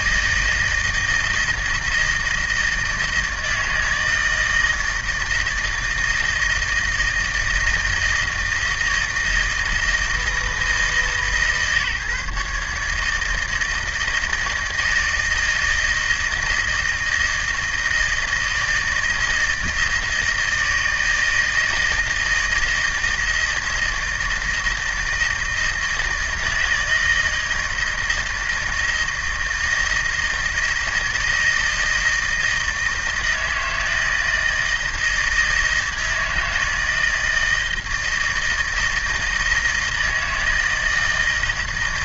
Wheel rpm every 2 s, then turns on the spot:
160, 160, 160, 160, 160, 160, 150, 160, 160, 160, 160, 160, 160, 160, 160, 160, 160, 160, 160, 160, 160.
none